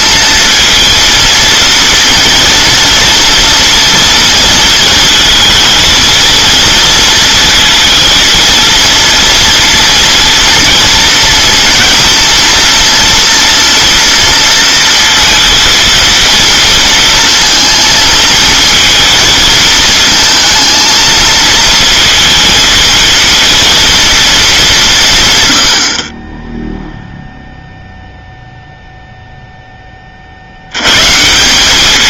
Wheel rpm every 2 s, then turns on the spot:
230, 230, 230, 230, 230, 230, 230, 230, 230, 230, 230, 230, 190, 0, 0, 110.
none